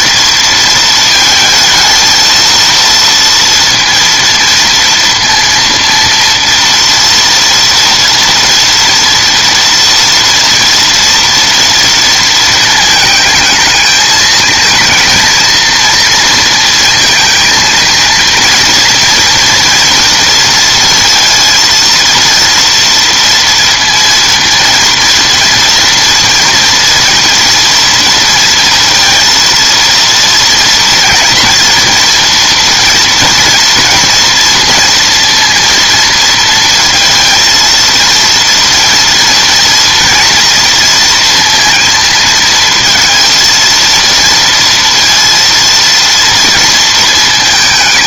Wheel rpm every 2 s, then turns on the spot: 230, 230, 230, 230, 230, 230, 220, 230, 230, 230, 230, 230, 230, 230, 230, 230, 240, 230, 230, 230, 230, 230, 230, 230.
none